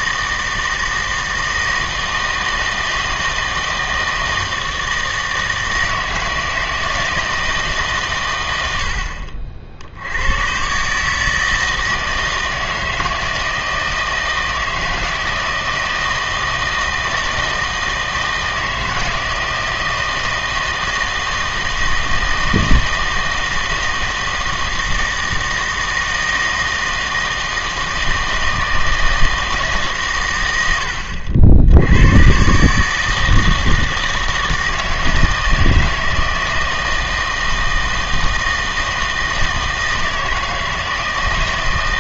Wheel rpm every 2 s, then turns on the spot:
160, 160, 160, 160, 80, 130, 160, 160, 160, 160, 160, 160, 160, 160, 160, 90, 140, 160, 160, 160, 160.
none